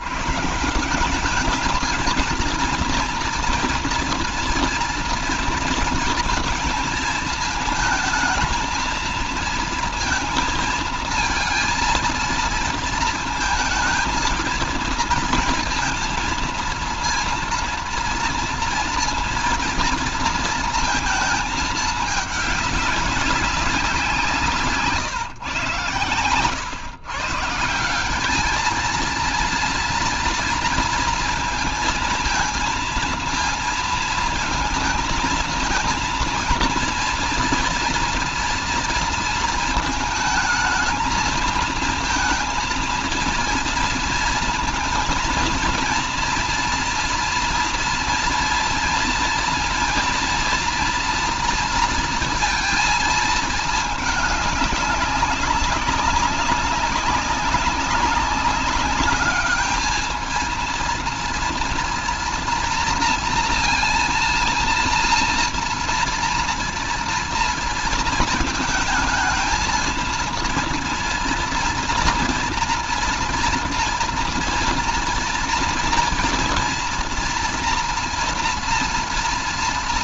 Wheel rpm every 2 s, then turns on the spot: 150, 230, 230, 220, 230, 230, 220, 230, 230, 230, 230, 200, 160, 130, 220, 230, 230, 220, 230, 230, 220, 230, 230, 230, 230, 230, 230, 210, 190, 200, 230, 230, 240, 230, 220, 230, 230, 230, 230, 230.
none